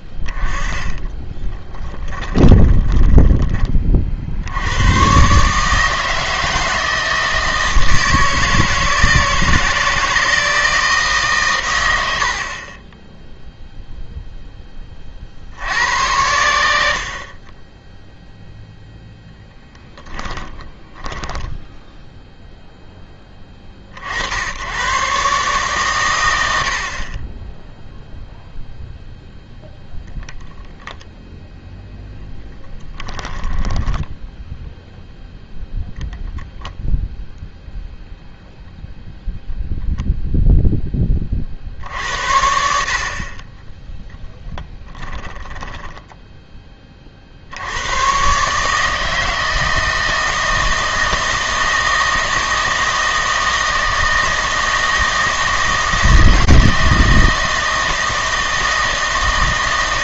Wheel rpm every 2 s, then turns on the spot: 10, 20, 90, 160, 160, 160, 30, 20, 80, 0, 20, 0, 80, 80, 0, 0, 10, 0, 0, 0, 0, 60, 20, 20, 140, 160, 160, 160, 160, 160.
0-4 20-22 32-34 44-46